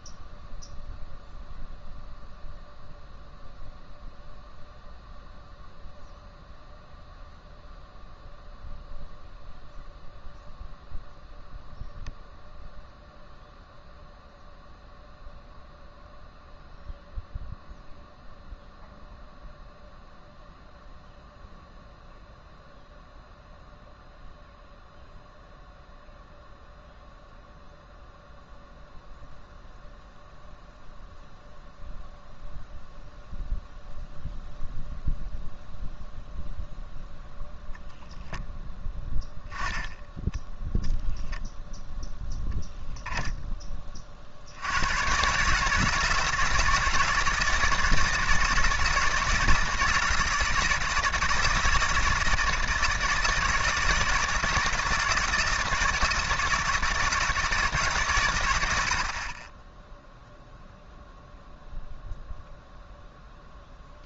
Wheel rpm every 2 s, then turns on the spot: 0, 0, 0, 0, 0, 0, 0, 0, 0, 0, 0, 0, 0, 0, 0, 0, 0, 0, 0, 0, 0, 0, 90, 160, 160, 160, 160, 160, 160, 90, 0, 0.
none